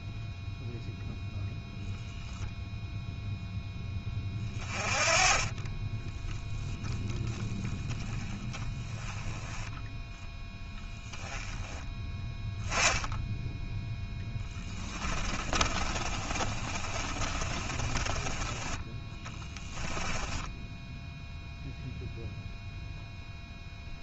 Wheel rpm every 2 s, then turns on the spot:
0, 0, 20, 10, 10, 10, 10, 20, 30, 10, 0, 0.
14-18